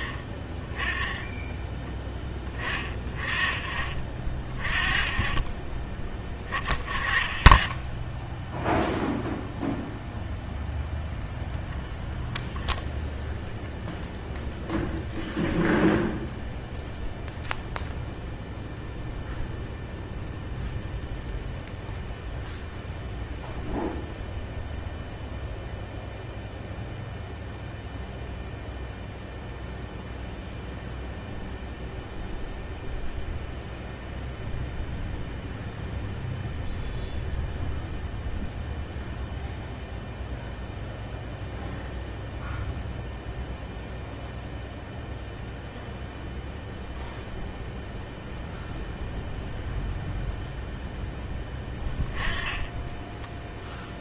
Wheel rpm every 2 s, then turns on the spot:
10, 30, 30, 20, 0, 0, 0, 0, 0, 0, 0, 0, 0, 0, 0, 0, 0, 0, 0, 0, 0, 0, 0, 0, 0, 0, 10.
none